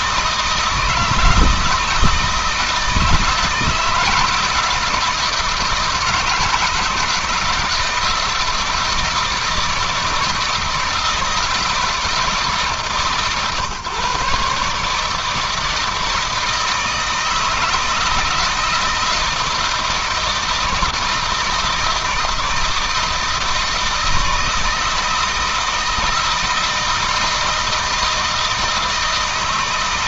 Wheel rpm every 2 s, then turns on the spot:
160, 160, 160, 160, 160, 160, 140, 150, 160, 160, 160, 160, 160, 160, 160.
none